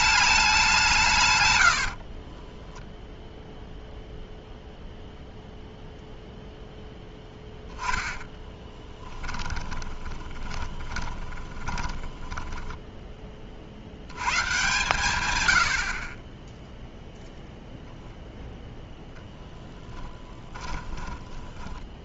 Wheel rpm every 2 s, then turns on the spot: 0, 0, 0, 10, 20, 20, 110, 30, 0, 20, 10.
6-12 18-22